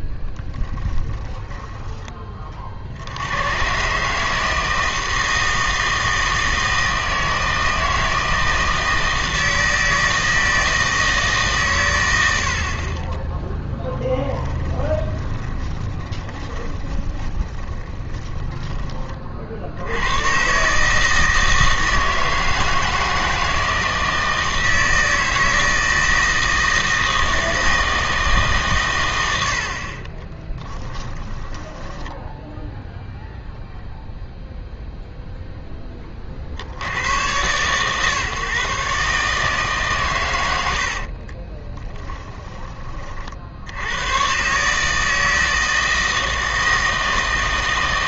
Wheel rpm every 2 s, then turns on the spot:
10, 60, 160, 160, 160, 160, 50, 10, 20, 20, 150, 160, 160, 160, 120, 10, 0, 0, 80, 140, 70, 20, 150, 160.
0-2 14-18 30-32 40-42